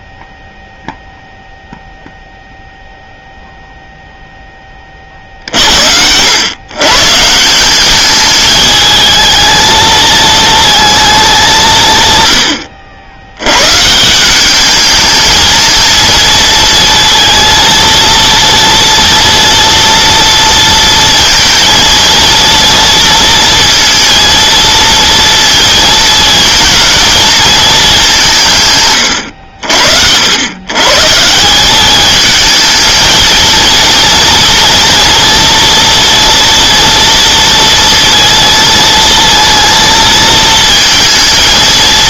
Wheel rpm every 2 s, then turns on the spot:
0, 0, 20, 110, 210, 220, 90, 200, 230, 230, 230, 230, 230, 220, 150, 110, 220, 230, 230, 230, 220.
none